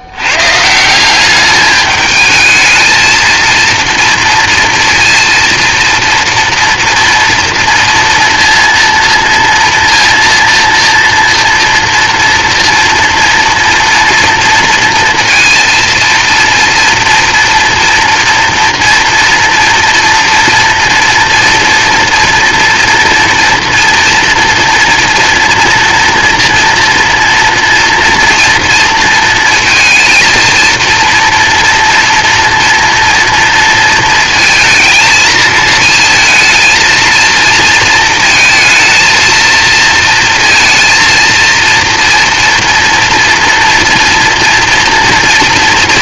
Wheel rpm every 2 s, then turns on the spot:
160, 220, 230, 230, 230, 230, 230, 230, 230, 230, 230, 240, 240, 230, 230, 230, 230, 220, 230, 230, 230, 230, 230.
none